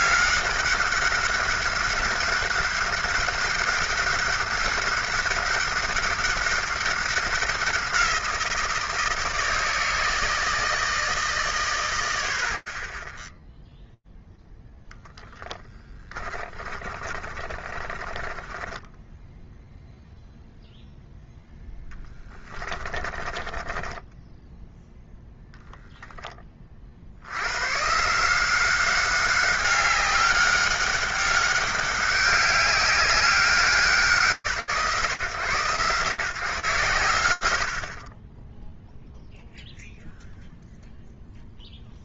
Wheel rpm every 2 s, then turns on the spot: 200, 200, 190, 190, 170, 160, 40, 0, 30, 20, 0, 20, 0, 50, 190, 190, 200, 110, 70, 0, 0.
16-20 22-24